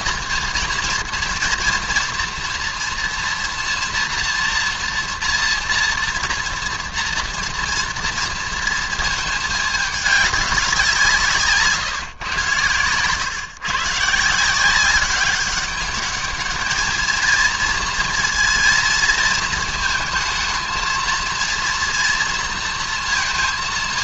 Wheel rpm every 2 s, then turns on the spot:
230, 230, 230, 230, 230, 190, 120, 170, 210, 230, 220, 230.
none